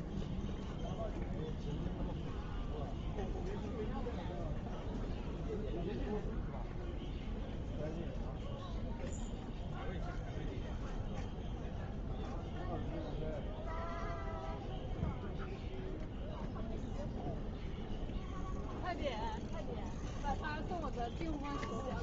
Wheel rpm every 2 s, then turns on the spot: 0, 0, 0, 0, 0, 0, 0, 0, 0, 0, 0.
none